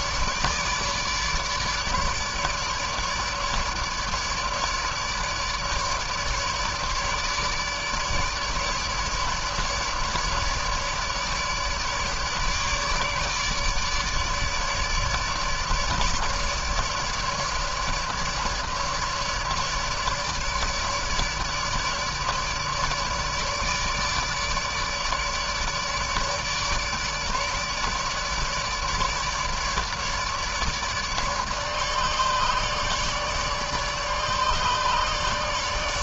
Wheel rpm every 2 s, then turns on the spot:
150, 150, 150, 150, 150, 150, 150, 150, 150, 150, 150, 150, 150, 150, 150, 150, 150, 150.
none